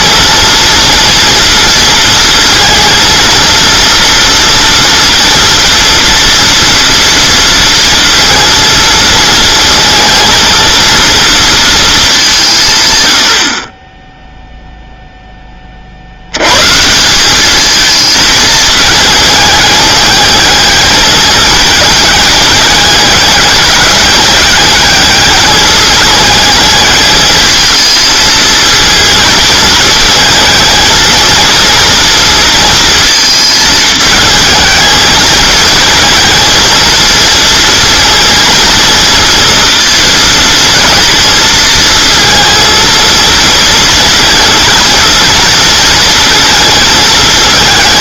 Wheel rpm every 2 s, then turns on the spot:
230, 230, 240, 230, 230, 230, 150, 0, 130, 220, 210, 200, 200, 220, 230, 220, 220, 220, 230, 230, 230, 230, 230, 220.
none